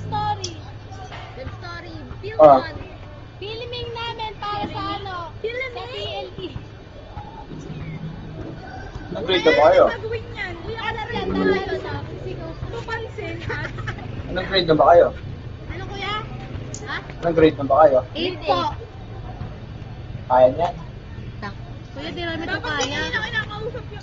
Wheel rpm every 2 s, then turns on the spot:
0, 0, 0, 0, 0, 0, 0, 0, 0, 0, 0, 0.
none